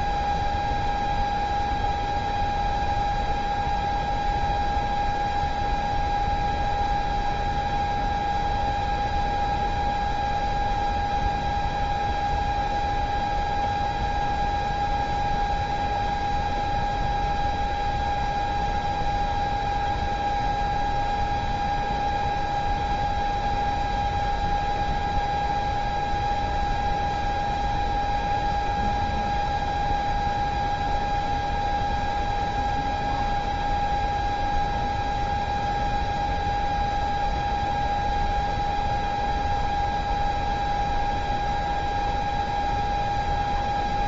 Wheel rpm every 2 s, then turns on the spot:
0, 0, 0, 0, 0, 0, 0, 0, 0, 0, 0, 0, 0, 0, 0, 0, 0, 0, 0, 0, 0, 0.
none